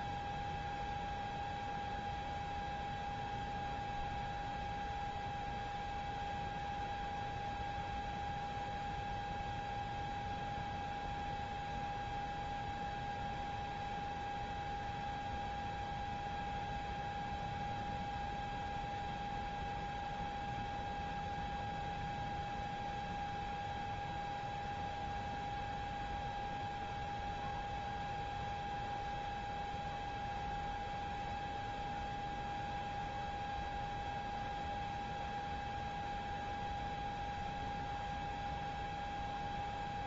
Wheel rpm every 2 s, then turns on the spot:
0, 0, 0, 0, 0, 0, 0, 0, 0, 0, 0, 0, 0, 0, 0, 0, 0, 0, 0, 0.
none